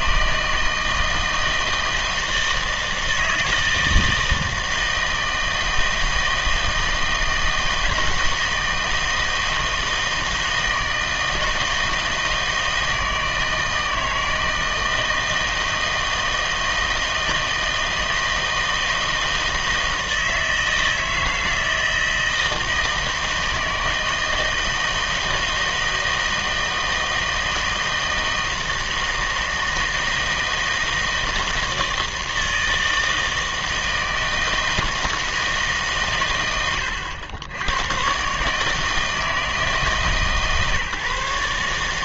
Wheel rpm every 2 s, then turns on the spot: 160, 160, 160, 160, 160, 160, 160, 160, 160, 160, 160, 160, 160, 160, 160, 160, 160, 160, 110, 150, 140.
none